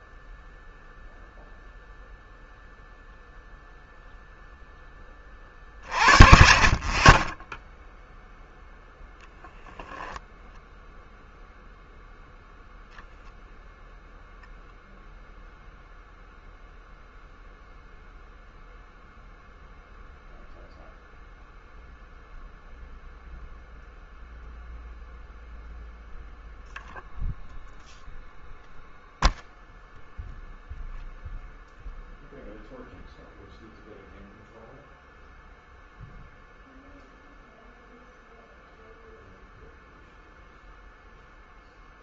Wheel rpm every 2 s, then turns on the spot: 0, 0, 0, 50, 0, 0, 0, 0, 0, 0, 0, 0, 0, 0, 0, 0, 0, 0, 0, 0, 0.
none